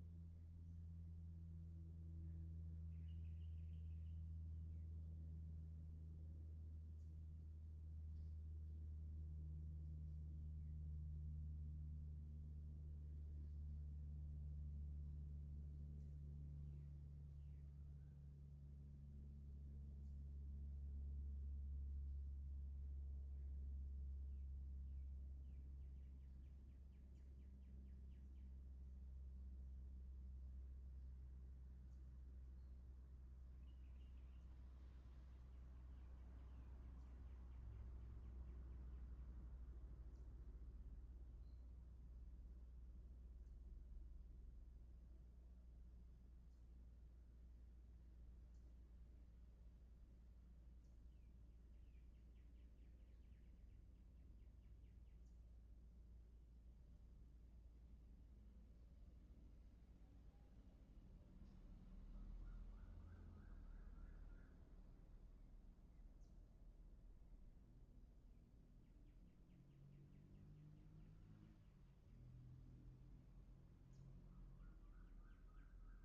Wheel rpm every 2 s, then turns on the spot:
0, 0, 0, 0, 0, 0, 0, 0, 0, 0, 0, 0, 0, 0, 0, 0, 0, 0, 0, 0, 0, 0, 0, 0, 0, 0, 0, 0, 0, 0, 0, 0, 0, 0, 0, 0, 0, 0.
none